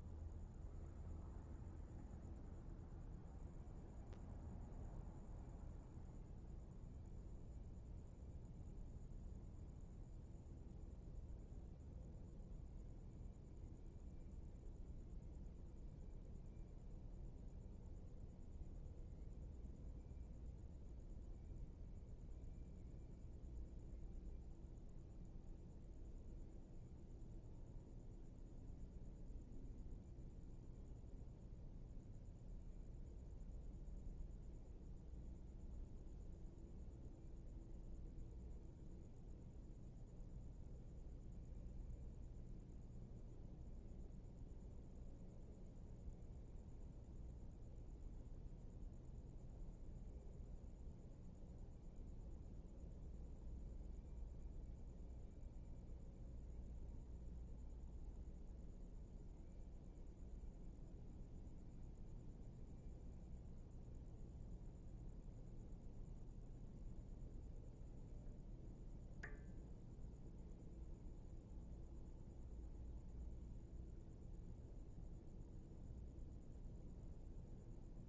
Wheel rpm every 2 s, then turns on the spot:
0, 0, 0, 0, 0, 0, 0, 0, 0, 0, 0, 0, 0, 0, 0, 0, 0, 0, 0, 0, 0, 0, 0, 0, 0, 0, 0, 0, 0, 0, 0, 0, 0, 0, 0, 0, 0, 0, 0.
none